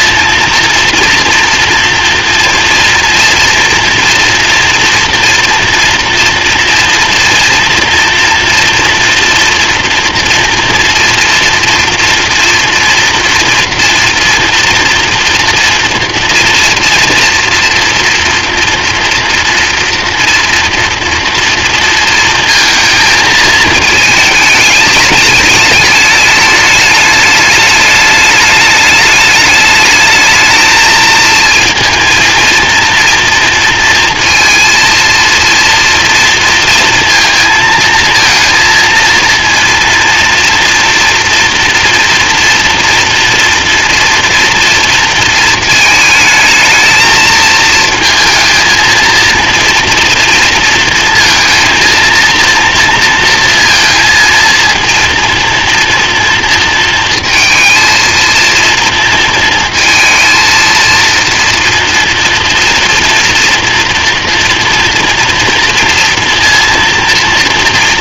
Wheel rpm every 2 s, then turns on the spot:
240, 230, 230, 230, 230, 240, 230, 230, 230, 230, 230, 230, 210, 210, 210, 220, 230, 230, 230, 230, 230, 230, 230, 220, 220, 230, 230, 230, 230, 230, 230, 240, 230, 240.
none